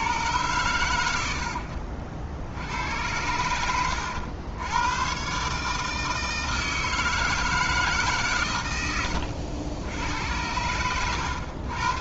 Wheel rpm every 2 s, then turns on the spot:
110, 80, 90, 160, 100, 100.
none